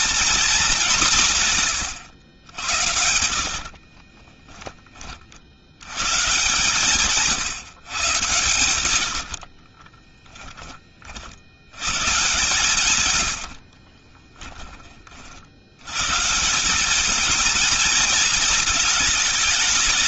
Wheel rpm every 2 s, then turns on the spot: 210, 80, 10, 130, 100, 20, 140, 20, 170, 220.
2-4 8-10 12-14